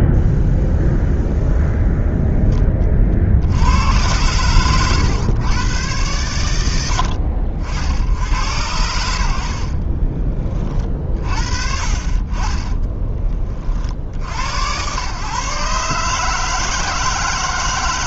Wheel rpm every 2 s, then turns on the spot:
0, 20, 110, 80, 80, 40, 20, 110, 160.
4-6